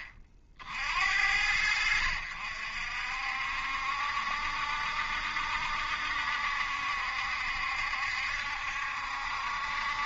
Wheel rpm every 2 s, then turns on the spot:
40, 60, 70, 70, 70.
none